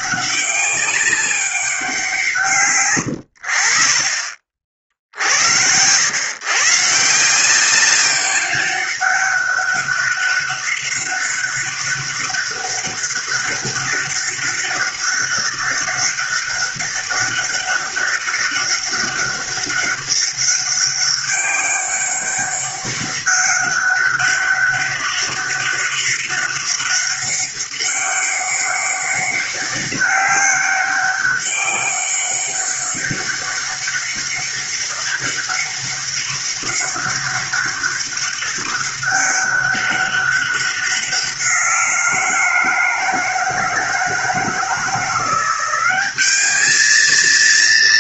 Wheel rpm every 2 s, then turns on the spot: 200, 90, 60, 160, 200, 190, 200, 200, 200, 200, 200, 200, 200, 200, 200, 200, 200, 200, 200, 200, 180, 160, 170, 220.
none